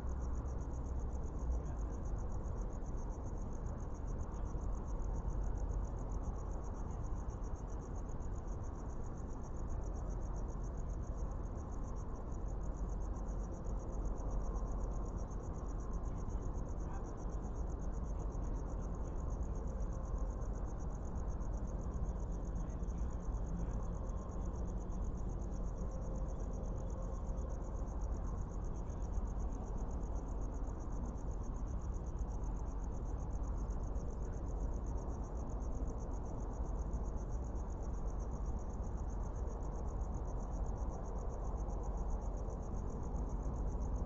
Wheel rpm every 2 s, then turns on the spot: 0, 0, 0, 0, 0, 0, 0, 0, 0, 0, 0, 0, 0, 0, 0, 0, 0, 0, 0, 0, 0, 0.
none